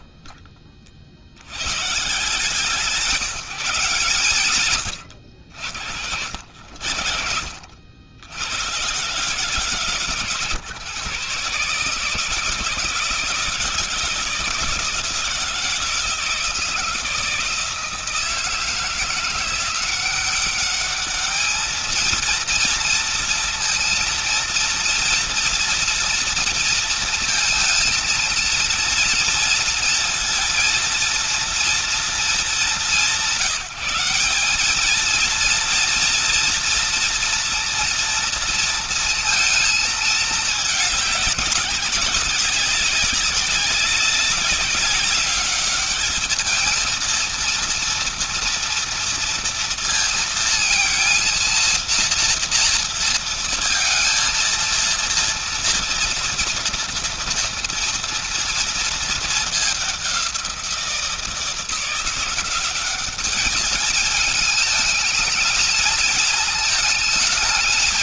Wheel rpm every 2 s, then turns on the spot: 30, 170, 110, 60, 100, 140, 160, 170, 160, 160, 200, 230, 230, 230, 230, 230, 200, 200, 230, 230, 210, 200, 200, 220, 230, 230, 230, 230, 230, 230, 180, 190, 220, 230.
none